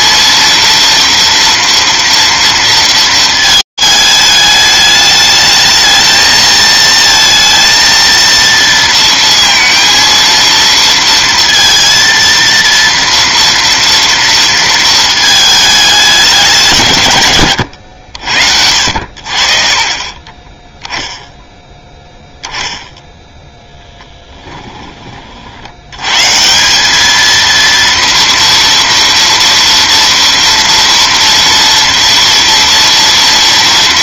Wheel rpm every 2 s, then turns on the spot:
230, 230, 210, 220, 230, 230, 230, 230, 190, 70, 20, 0, 20, 200, 230, 230, 230.
20-22